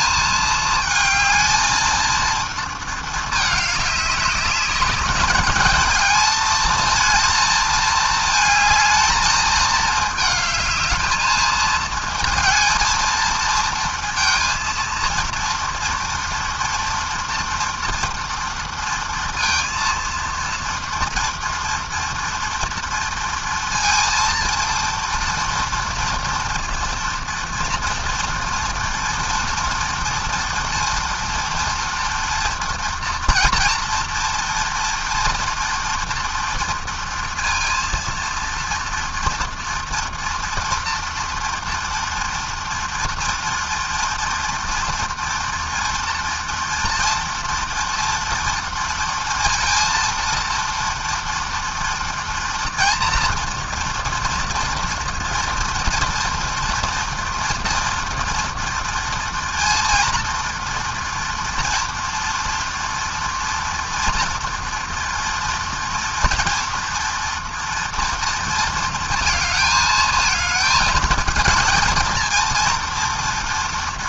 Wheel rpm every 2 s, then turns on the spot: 220, 220, 210, 230, 220, 220, 230, 230, 230, 230, 230, 230, 230, 230, 230, 230, 230, 240, 230, 230, 230, 230, 230, 230, 230, 240, 240, 230, 230, 230, 230, 240, 240, 240, 230, 220, 240.
none